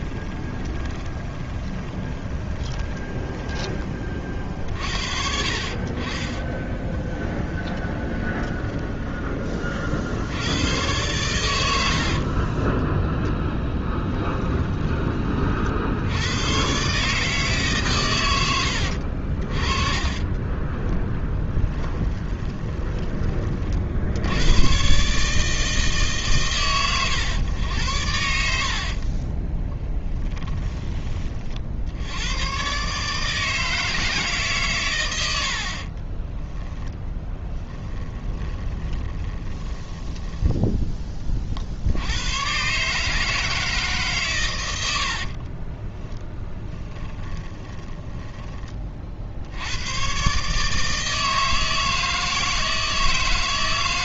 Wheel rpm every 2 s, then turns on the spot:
20, 20, 50, 10, 10, 100, 20, 10, 120, 90, 10, 20, 120, 120, 60, 20, 130, 130, 10, 20, 10, 130, 90, 10, 30, 150, 160.
0-4 6-10 12-14 20-24 36-40 46-48